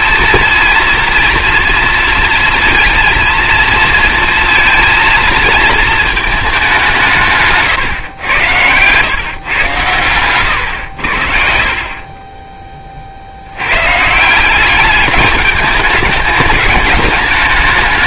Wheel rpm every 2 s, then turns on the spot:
230, 230, 230, 200, 100, 110, 20, 190, 210.
8-10